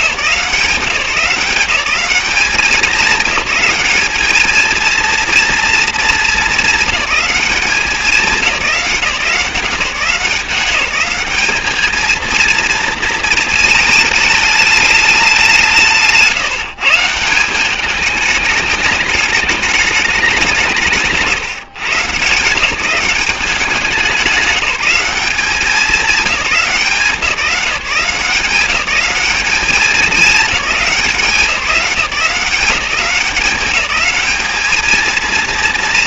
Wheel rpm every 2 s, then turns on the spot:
180, 190, 220, 210, 190, 170, 230, 210, 150, 220, 180, 150, 190, 180, 190, 210, 180, 210.
none